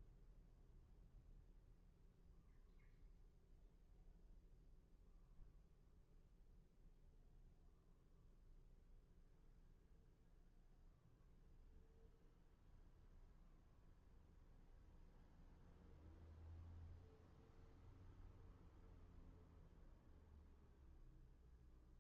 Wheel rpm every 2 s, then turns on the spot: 0, 0, 0, 0, 0, 0, 0, 0, 0, 0, 0.
none